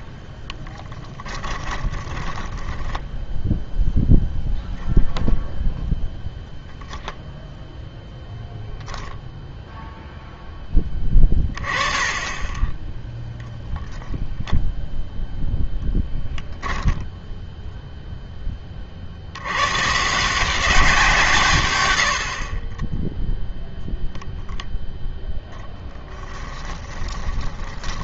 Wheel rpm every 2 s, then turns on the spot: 10, 10, 0, 0, 0, 0, 10, 0, 10, 10, 170, 50, 0, 10.
2-4 26-28